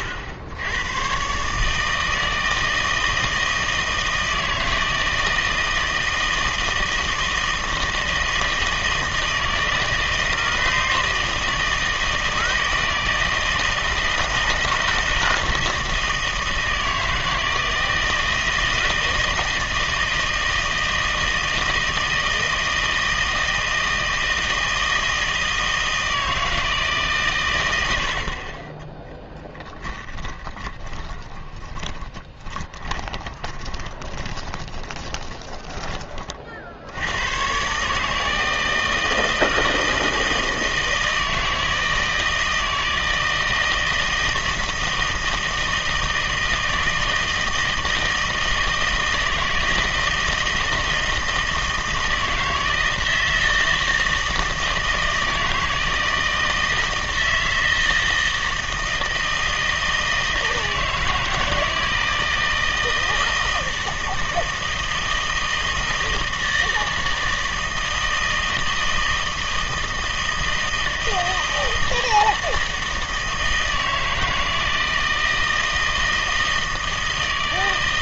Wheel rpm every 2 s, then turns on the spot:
90, 160, 160, 160, 160, 160, 160, 160, 160, 160, 160, 160, 160, 160, 30, 20, 20, 20, 70, 160, 160, 160, 160, 160, 160, 160, 160, 160, 160, 160, 160, 160, 160, 160, 160, 160, 160, 160, 160.
30-36